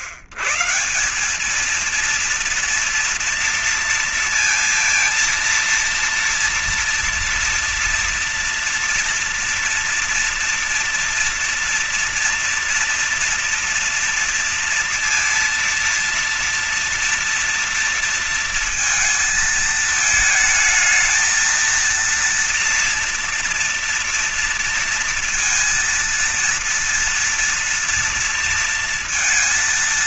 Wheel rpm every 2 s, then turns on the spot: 130, 230, 230, 230, 240, 240, 240, 230, 230, 230, 220, 230, 230, 230, 230.
none